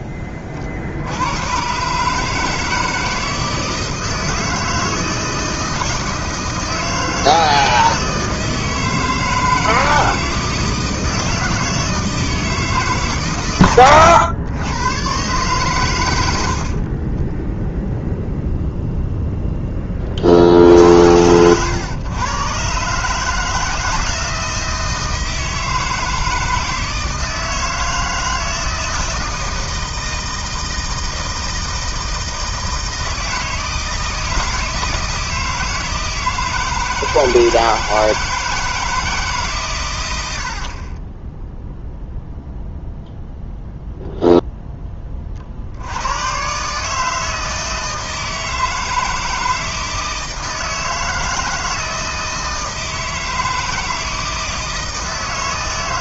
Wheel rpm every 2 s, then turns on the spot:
40, 160, 160, 160, 160, 160, 150, 120, 40, 0, 60, 130, 160, 160, 160, 160, 160, 160, 160, 160, 40, 0, 10, 140, 160, 160, 160, 160.
16-18 40-42